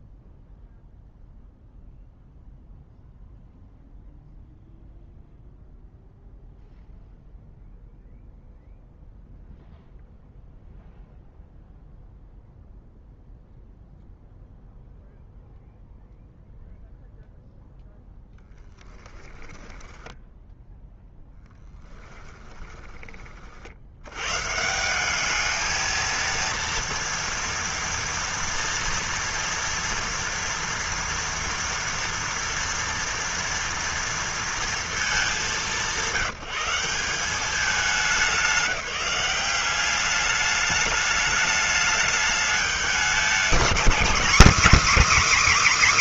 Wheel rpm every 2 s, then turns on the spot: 0, 0, 0, 0, 0, 0, 0, 0, 0, 10, 0, 20, 170, 230, 230, 230, 230, 220, 180, 180, 210, 210, 290.
18-20